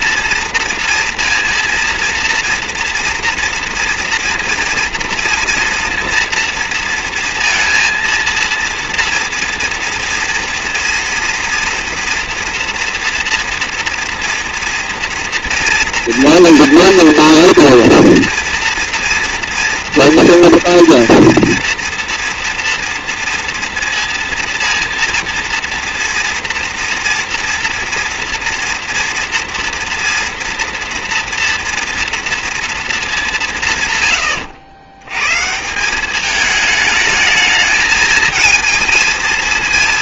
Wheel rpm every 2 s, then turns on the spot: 230, 230, 230, 230, 230, 230, 230, 230, 230, 230, 230, 230, 230, 230, 230, 230, 220, 110, 210, 220.
none